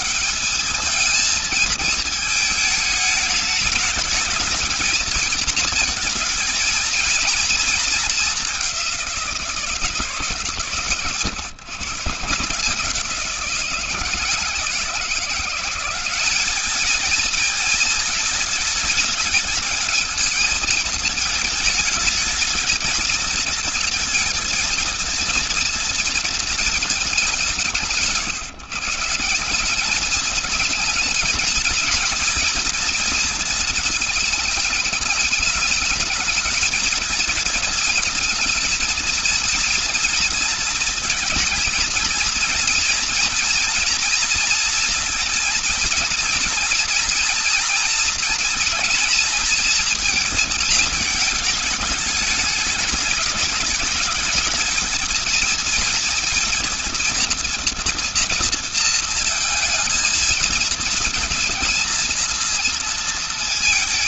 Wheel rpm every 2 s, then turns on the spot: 210, 210, 220, 230, 200, 140, 150, 170, 210, 210, 220, 220, 230, 230, 150, 220, 230, 220, 220, 230, 230, 230, 240, 230, 240, 230, 210, 210, 230, 230, 230, 230.
none